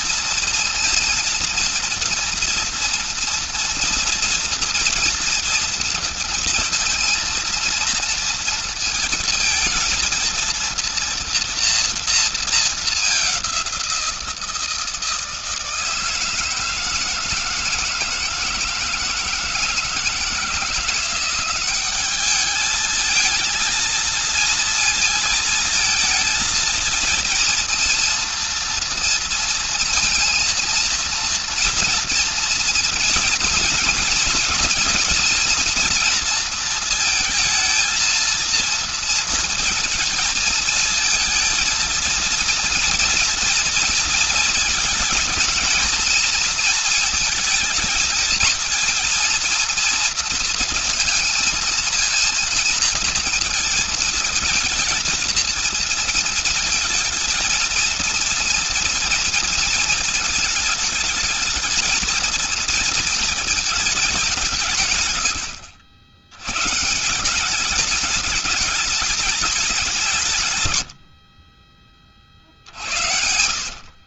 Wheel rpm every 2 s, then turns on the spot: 230, 230, 230, 230, 230, 230, 210, 160, 160, 160, 170, 210, 220, 230, 230, 230, 230, 240, 230, 230, 220, 230, 230, 230, 220, 230, 230, 230, 220, 230, 220, 230, 170, 100, 210, 130, 60.
none